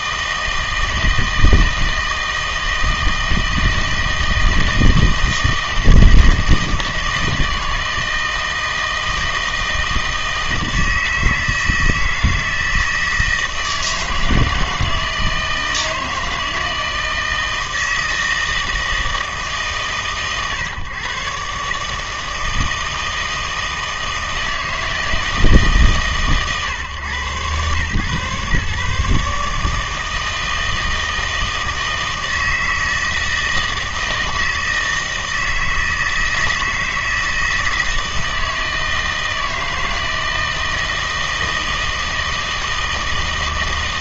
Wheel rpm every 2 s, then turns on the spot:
160, 160, 160, 160, 160, 160, 160, 160, 160, 160, 120, 160, 160, 120, 140, 160, 160, 160, 160, 160, 160, 160.
none